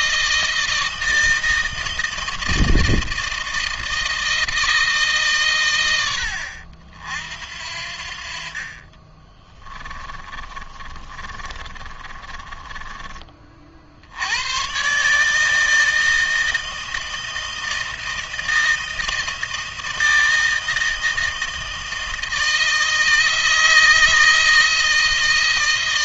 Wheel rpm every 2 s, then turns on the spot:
160, 160, 160, 70, 40, 20, 20, 110, 160, 160, 160, 160, 160.
10-14